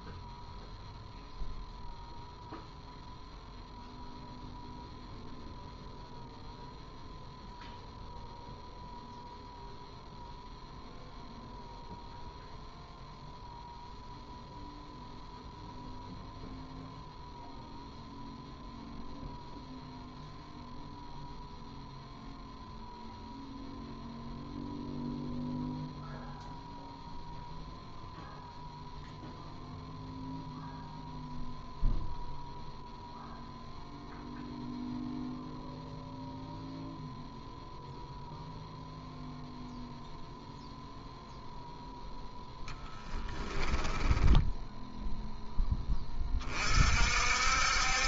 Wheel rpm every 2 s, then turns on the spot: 0, 0, 0, 0, 0, 0, 0, 0, 0, 0, 0, 0, 0, 0, 0, 0, 0, 0, 0, 0, 0, 10, 10, 40.
42-44